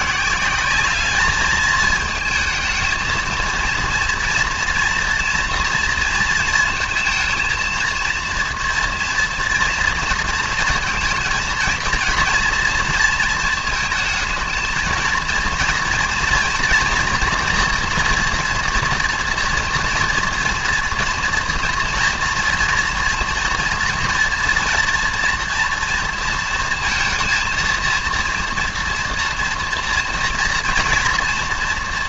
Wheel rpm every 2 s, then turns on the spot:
190, 220, 230, 230, 230, 230, 230, 220, 230, 230, 230, 230, 230, 230, 230, 230.
none